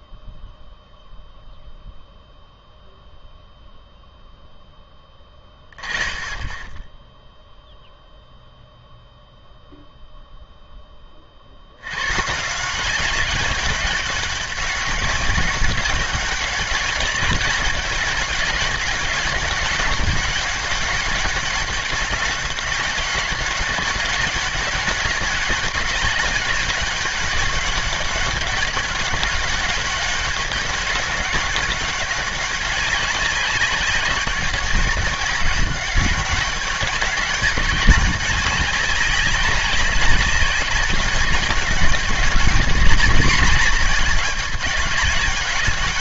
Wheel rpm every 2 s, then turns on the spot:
0, 0, 10, 30, 0, 0, 160, 200, 190, 200, 200, 200, 200, 200, 200, 200, 200, 190, 190, 200, 200, 220, 200.
none